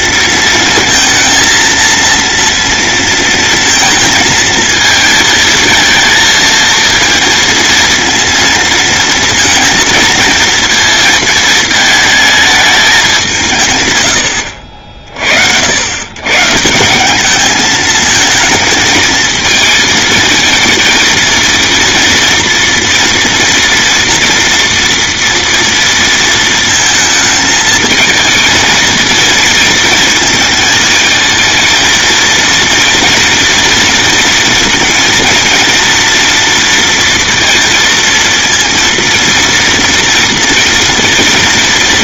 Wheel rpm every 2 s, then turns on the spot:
230, 230, 220, 230, 230, 230, 210, 60, 180, 220, 230, 230, 230, 220, 230, 220, 230, 230, 230, 230, 230.
none